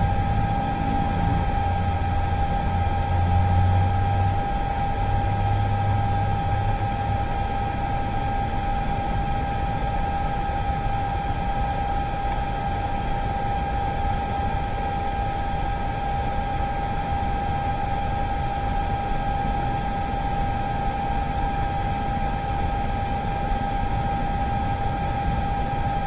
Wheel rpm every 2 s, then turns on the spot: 0, 0, 0, 0, 0, 0, 0, 0, 0, 0, 0, 0, 0.
none